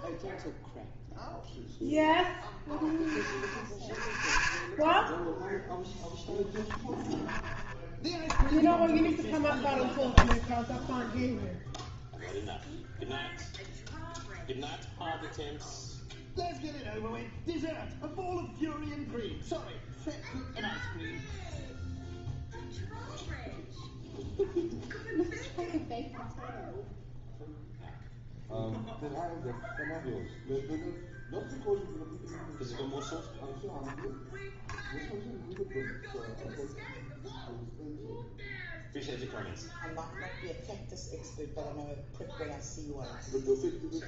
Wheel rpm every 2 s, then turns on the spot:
0, 0, 0, 0, 0, 0, 0, 0, 0, 0, 0, 0, 0, 0, 0, 0, 0, 0, 0, 0, 0, 0.
none